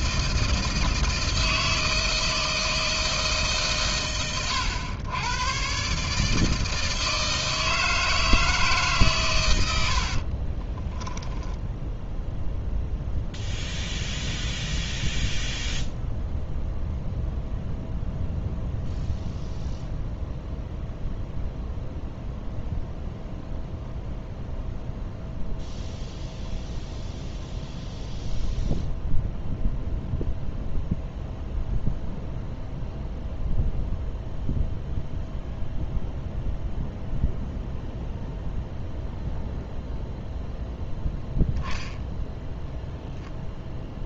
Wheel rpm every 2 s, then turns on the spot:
160, 160, 110, 160, 150, 20, 0, 0, 0, 0, 0, 0, 0, 0, 0, 0, 0, 0, 0, 0, 0, 0.
10-12